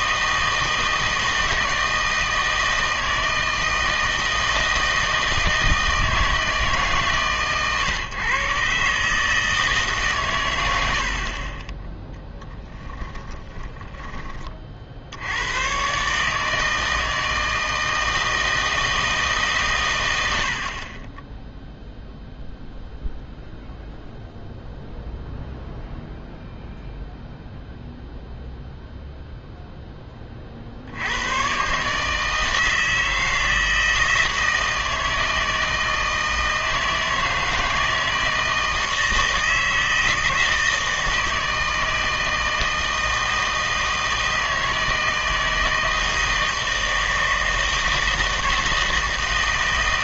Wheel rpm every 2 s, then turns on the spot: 160, 160, 160, 150, 130, 110, 10, 40, 160, 160, 70, 0, 0, 0, 0, 40, 160, 160, 160, 160, 160, 160, 160, 160, 160.
12-14